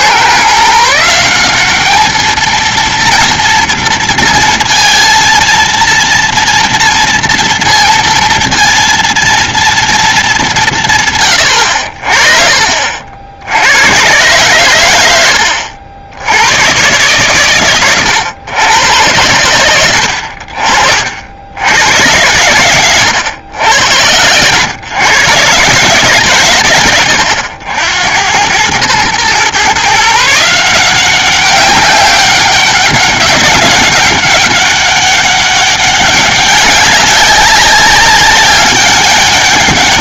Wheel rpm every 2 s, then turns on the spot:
140, 220, 230, 230, 230, 200, 40, 120, 100, 120, 60, 100, 100, 130, 90, 160, 190, 190, 200, 200.
none